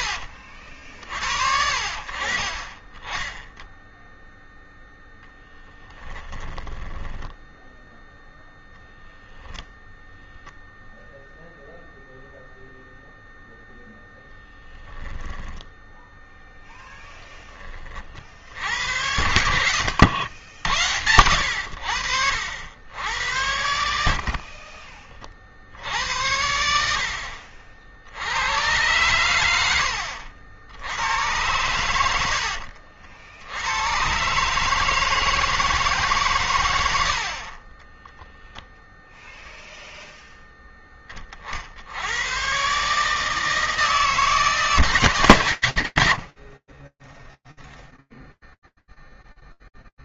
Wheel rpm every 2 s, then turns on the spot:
50, 30, 0, 10, 10, 0, 0, 10, 10, 80, 90, 80, 50, 70, 100, 70, 80, 140, 130, 10, 10, 120, 150, 40, 0.
6-8 14-16 24-26 38-40